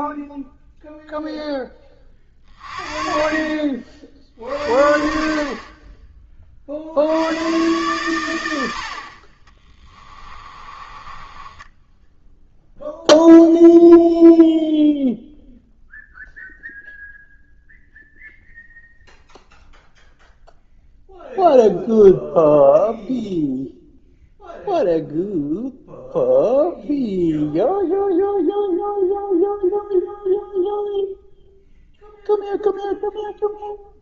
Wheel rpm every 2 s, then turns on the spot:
0, 30, 60, 50, 70, 20, 0, 0, 0, 0, 0, 0, 0, 0, 0, 0, 0.
10-12